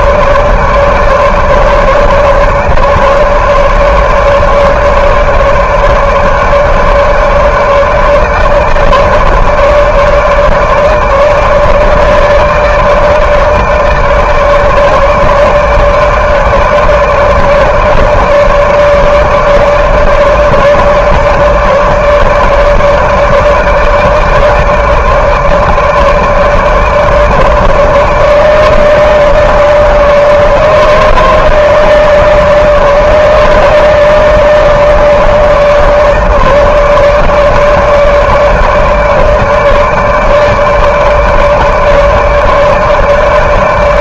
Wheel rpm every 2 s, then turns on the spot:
150, 150, 150, 150, 150, 150, 150, 150, 150, 150, 150, 160, 150, 150, 150, 150, 150, 150, 150, 150, 150, 150.
none